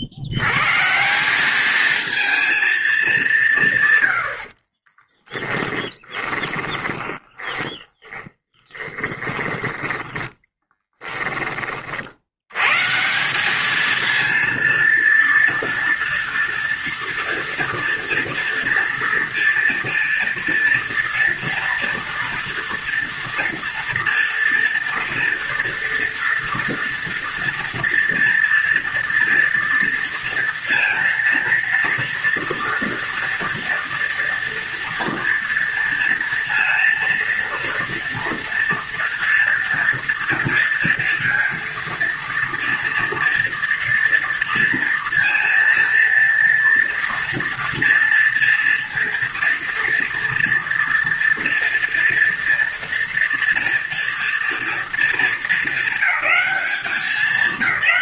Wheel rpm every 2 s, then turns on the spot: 70, 230, 60, 20, 10, 10, 100, 230, 230, 230, 230, 230, 230, 230, 230, 230, 230, 230, 230, 230, 230, 230, 230, 230, 230, 230, 230, 230, 190.
4-12